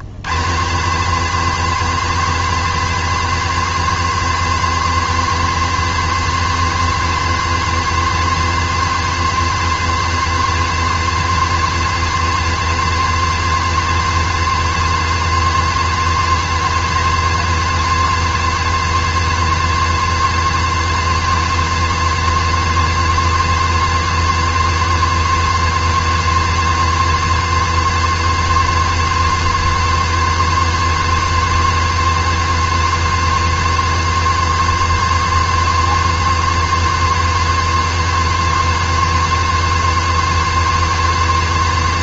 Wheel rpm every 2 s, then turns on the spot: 170, 260, 260, 260, 260, 260, 260, 260, 260, 260, 260, 260, 260, 260, 270, 260, 260, 270, 270, 270, 260.
none